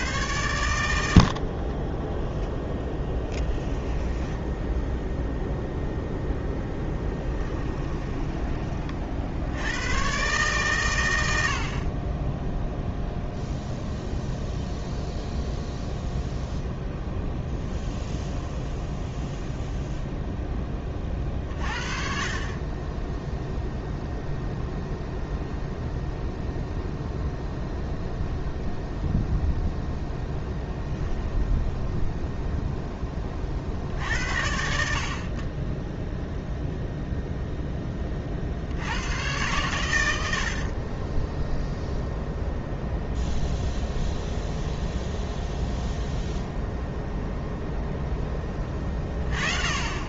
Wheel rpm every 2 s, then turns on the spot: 100, 0, 0, 10, 50, 120, 0, 0, 0, 0, 20, 20, 0, 0, 0, 0, 10, 40, 0, 90, 30, 0, 0, 0, 20.
40-42